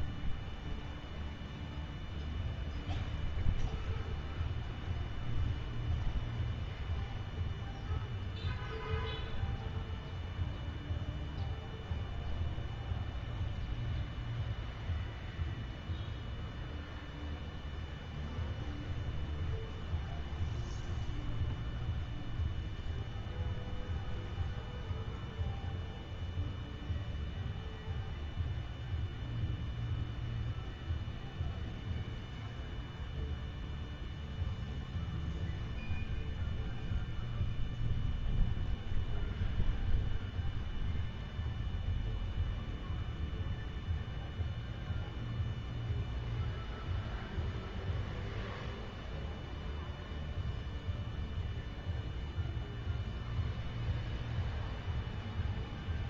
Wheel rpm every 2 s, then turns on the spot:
0, 0, 0, 0, 0, 0, 0, 0, 0, 0, 0, 0, 0, 0, 0, 0, 0, 0, 0, 0, 0, 0, 0, 0, 0, 0, 0, 0.
none